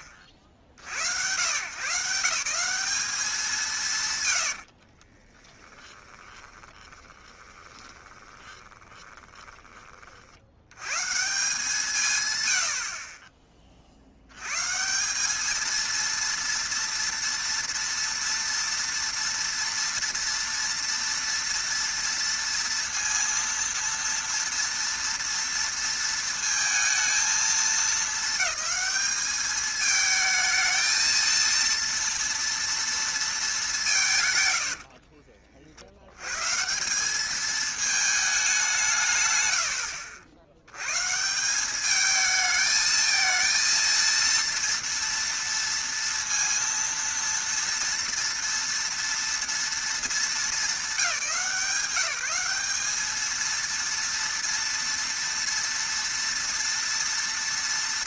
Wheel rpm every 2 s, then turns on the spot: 60, 210, 40, 10, 10, 110, 40, 150, 230, 230, 230, 230, 230, 230, 220, 220, 230, 90, 150, 190, 70, 220, 230, 230, 230, 200, 190, 230, 230.
4-10 34-36